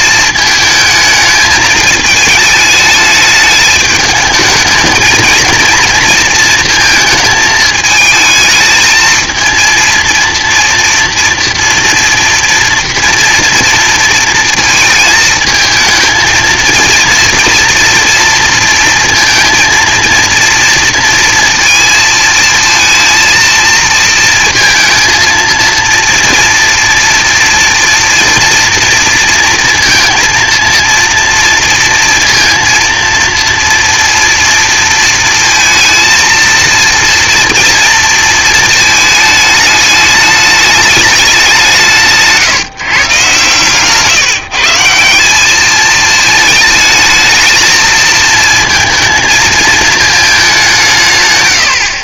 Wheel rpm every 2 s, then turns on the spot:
220, 220, 220, 220, 220, 240, 230, 230, 230, 230, 230, 230, 230, 240, 230, 230, 230, 230, 230, 220, 210, 140, 160, 220, 230, 180.
none